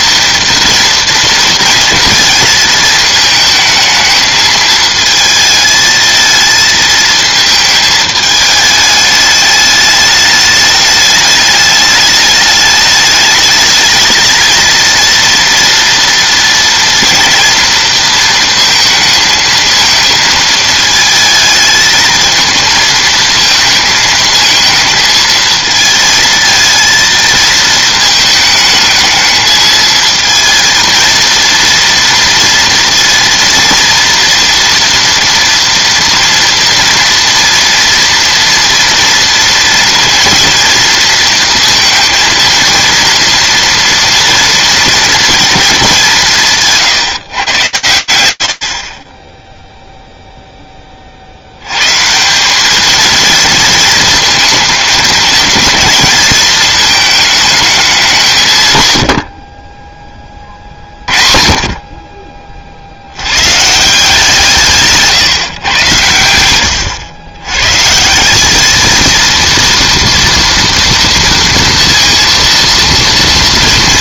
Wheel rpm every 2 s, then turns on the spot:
230, 220, 220, 220, 210, 210, 210, 230, 230, 230, 220, 220, 220, 220, 220, 230, 230, 230, 230, 230, 230, 230, 230, 140, 50, 30, 210, 230, 220, 110, 50, 110, 150, 110, 230, 230, 230.
48-50